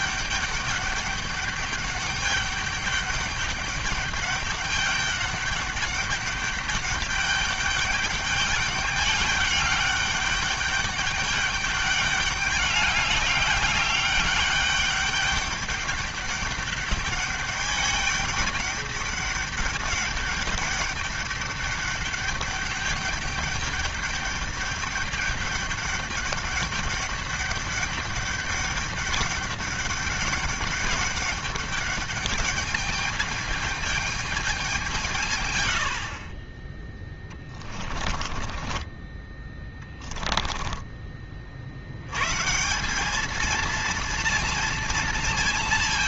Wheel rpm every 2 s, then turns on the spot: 200, 200, 200, 200, 210, 200, 200, 200, 200, 200, 200, 200, 210, 200, 200, 200, 210, 200, 40, 20, 20, 170, 230.
38-42